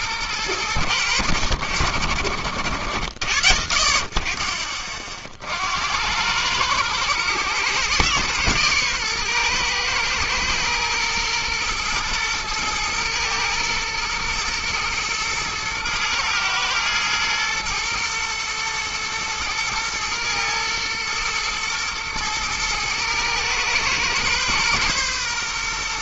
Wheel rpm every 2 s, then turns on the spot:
90, 60, 40, 110, 120, 120, 120, 120, 120, 120, 120, 110, 120.
none